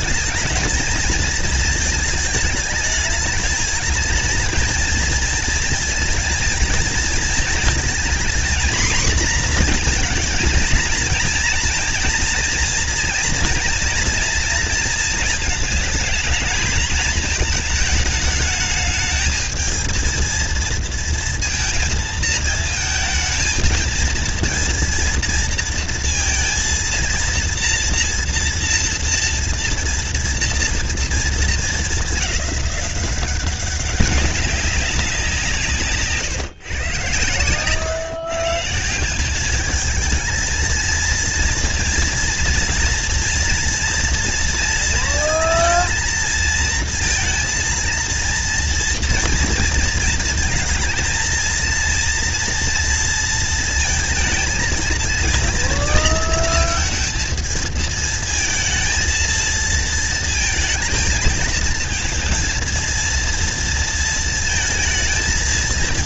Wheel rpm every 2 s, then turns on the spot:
210, 220, 220, 230, 240, 230, 240, 230, 220, 220, 230, 220, 230, 230, 230, 230, 200, 190, 130, 140, 220, 230, 230, 230, 230, 230, 230, 230, 230, 230, 220, 230, 230.
none